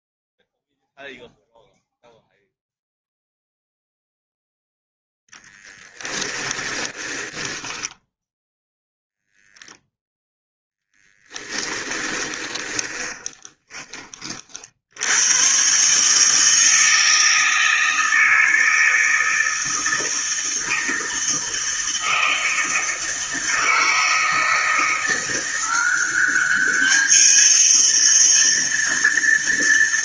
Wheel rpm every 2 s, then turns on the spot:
0, 0, 0, 20, 0, 0, 20, 80, 160, 160, 160, 160, 170, 210, 230.
6-8 12-14